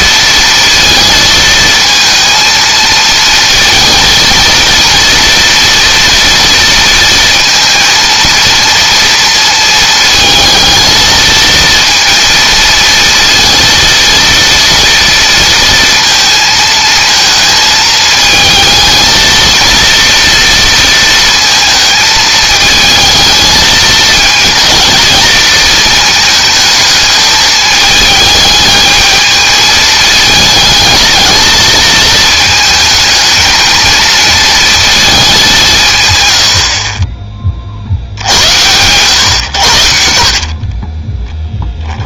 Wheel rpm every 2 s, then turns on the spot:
230, 230, 230, 230, 230, 220, 230, 230, 230, 220, 230, 220, 220, 220, 220, 220, 220, 230, 50, 100, 40.
40-42